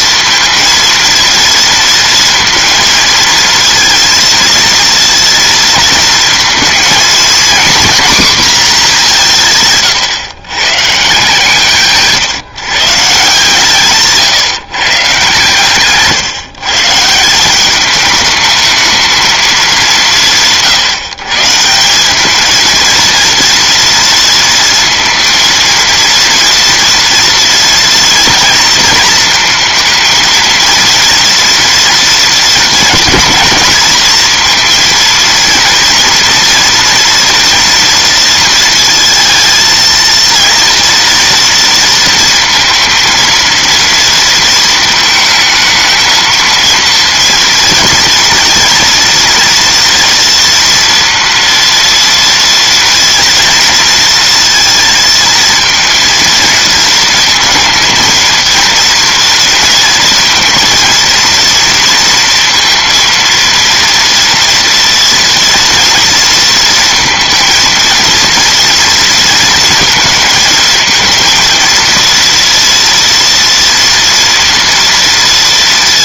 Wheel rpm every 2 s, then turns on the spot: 230, 230, 230, 220, 220, 150, 150, 140, 140, 220, 160, 220, 230, 230, 230, 230, 230, 230, 230, 230, 230, 230, 220, 230, 230, 230, 230, 230, 220, 230, 230, 230, 230, 230, 230, 220, 230, 230.
none